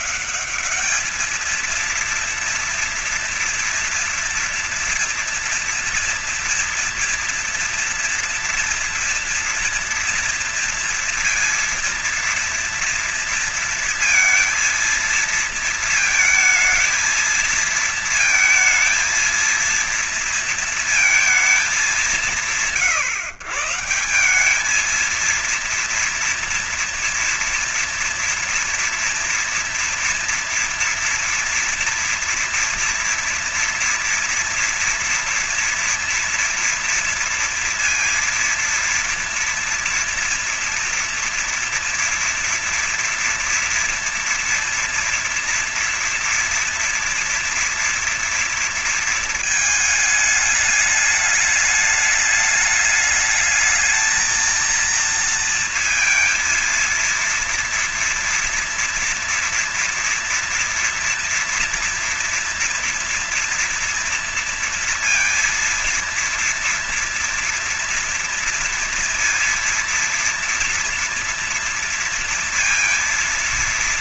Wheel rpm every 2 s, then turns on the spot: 210, 230, 230, 230, 240, 230, 230, 230, 220, 230, 230, 150, 190, 230, 230, 240, 230, 230, 230, 230, 230, 230, 230, 230, 230, 210, 210, 230, 230, 230, 230, 240, 240, 230, 230, 230, 230.
none